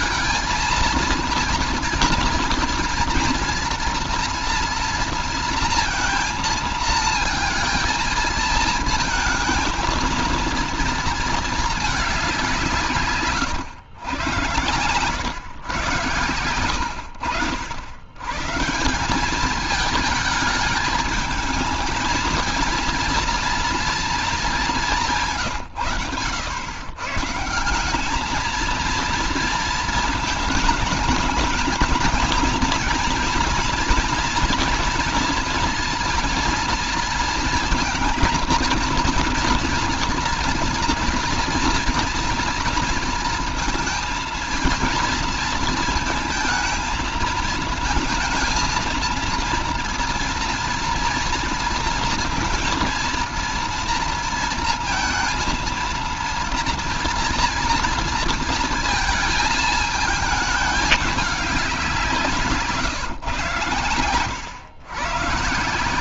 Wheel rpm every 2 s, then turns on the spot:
230, 230, 230, 230, 220, 230, 180, 110, 80, 160, 220, 230, 190, 110, 230, 220, 230, 240, 230, 230, 230, 230, 230, 230, 230, 240, 230, 230, 230, 220, 210, 150, 120.
none